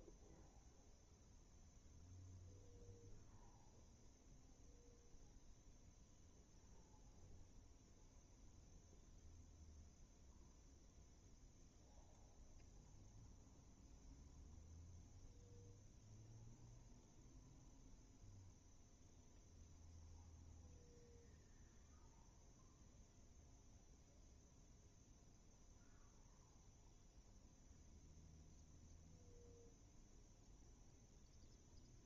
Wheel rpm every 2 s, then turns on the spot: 0, 0, 0, 0, 0, 0, 0, 0, 0, 0, 0, 0, 0, 0, 0, 0.
none